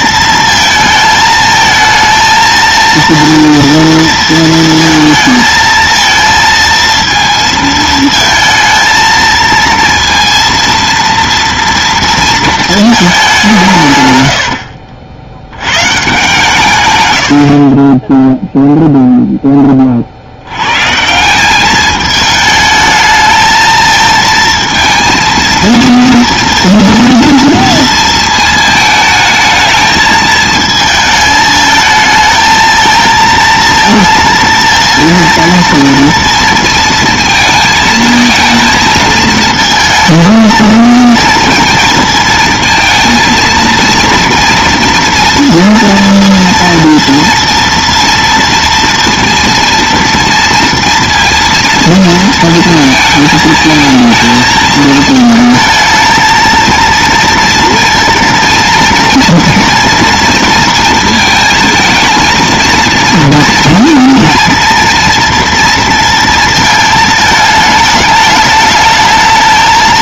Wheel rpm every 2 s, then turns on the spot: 230, 230, 230, 230, 230, 230, 220, 60, 140, 0, 110, 220, 230, 230, 220, 220, 220, 230, 230, 220, 220, 220, 230, 230, 230, 230, 230, 220, 230, 230, 230, 230, 230, 220, 210.
14-16